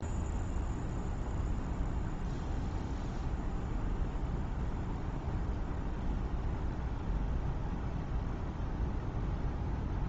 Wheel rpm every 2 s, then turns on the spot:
0, 0, 0, 0, 0.
none